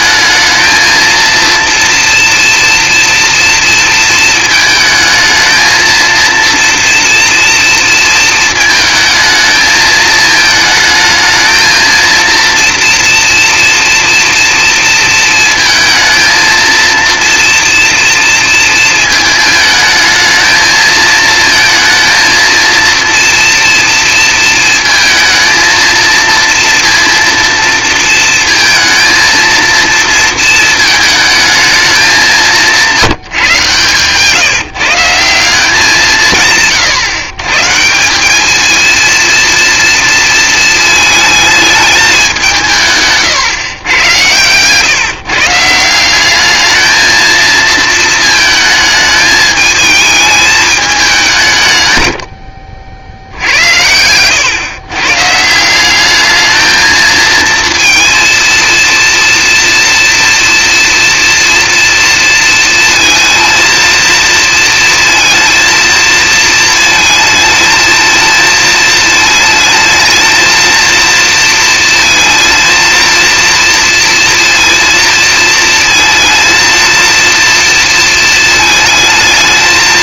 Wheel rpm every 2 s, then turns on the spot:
230, 230, 220, 230, 220, 220, 230, 230, 230, 230, 220, 230, 220, 230, 230, 220, 180, 160, 150, 220, 220, 160, 130, 220, 220, 210, 70, 130, 220, 230, 240, 230, 230, 230, 220, 230, 230, 230, 230, 220.
32-34